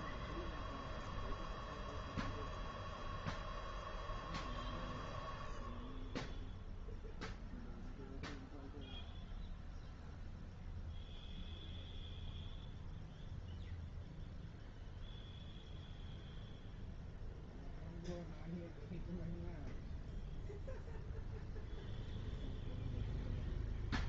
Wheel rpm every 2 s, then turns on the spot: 0, 0, 0, 0, 0, 0, 0, 0, 0, 0, 0, 0.
none